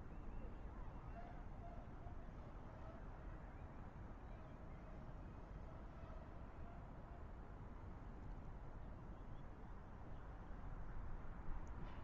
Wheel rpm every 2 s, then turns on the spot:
0, 0, 0, 0, 0, 0.
none